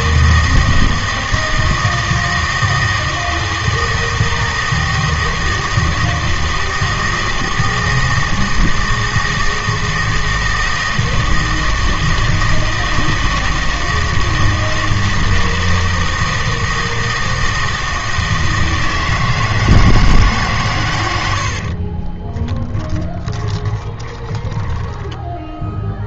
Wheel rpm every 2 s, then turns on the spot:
160, 160, 160, 160, 160, 160, 160, 160, 160, 160, 80, 30, 10.
20-24